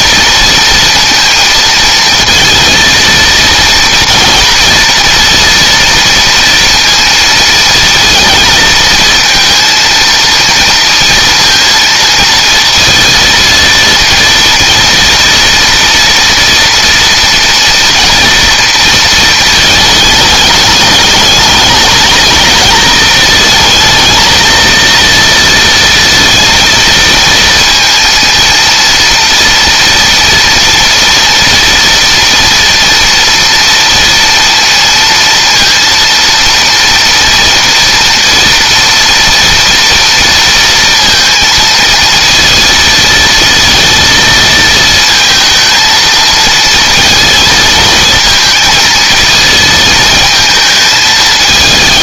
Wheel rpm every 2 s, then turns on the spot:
230, 230, 230, 230, 230, 230, 230, 230, 230, 220, 210, 220, 230, 220, 230, 240, 230, 230, 230, 230, 230, 230, 220, 220, 230, 220.
none